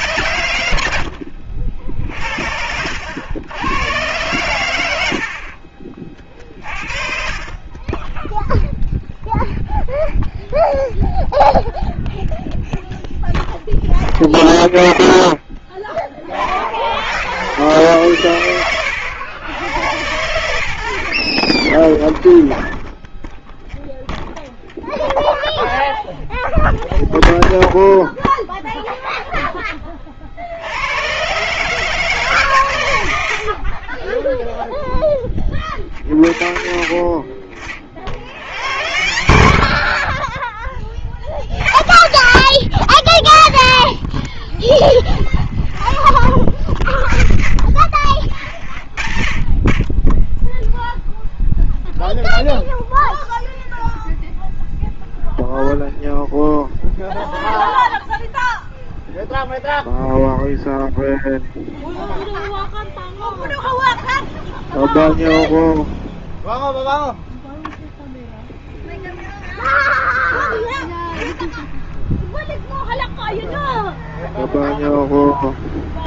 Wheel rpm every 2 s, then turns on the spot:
80, 60, 90, 40, 0, 0, 0, 0, 50, 100, 80, 0, 0, 0, 0, 60, 140, 10, 60, 90, 30, 30, 0, 20, 50, 0, 0, 0, 0, 0, 0, 0, 0, 0, 10, 10, 0, 0.
4-6 68-72